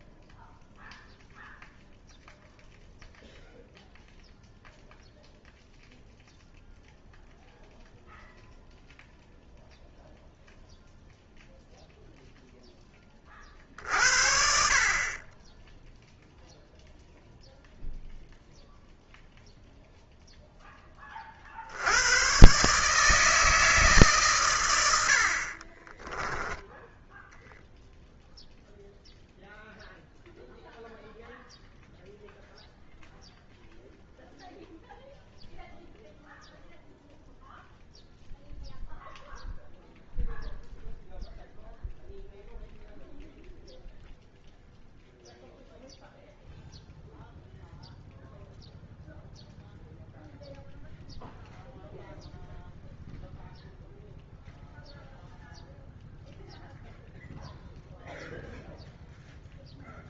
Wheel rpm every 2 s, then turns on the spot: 0, 0, 0, 0, 0, 0, 10, 50, 0, 0, 20, 150, 90, 10, 0, 0, 0, 0, 0, 0, 0, 0, 0, 0, 0, 0, 0, 0, 0, 0.
none